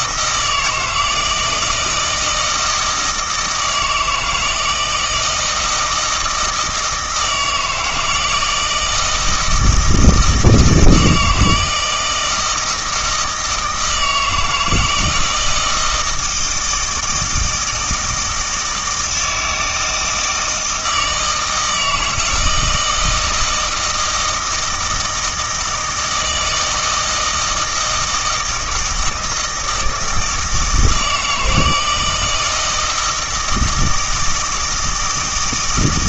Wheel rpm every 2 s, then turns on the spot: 160, 160, 160, 160, 160, 160, 160, 160, 160, 160, 160, 160, 160, 160, 160, 160, 160, 160.
none